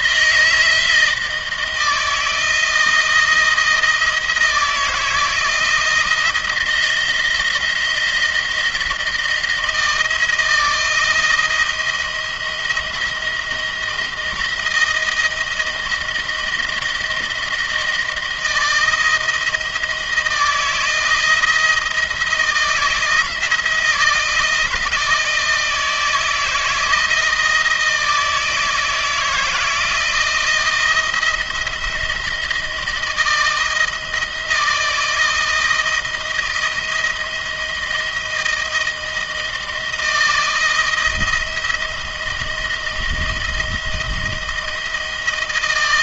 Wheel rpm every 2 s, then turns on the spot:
160, 160, 160, 170, 170, 160, 170, 160, 160, 160, 160, 160, 160, 160, 160, 170, 160, 160, 170, 160, 160, 170, 160.
none